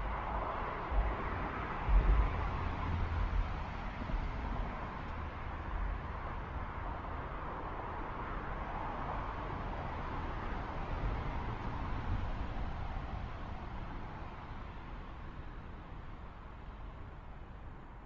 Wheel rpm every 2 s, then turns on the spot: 0, 0, 0, 0, 0, 0, 0, 0, 0.
none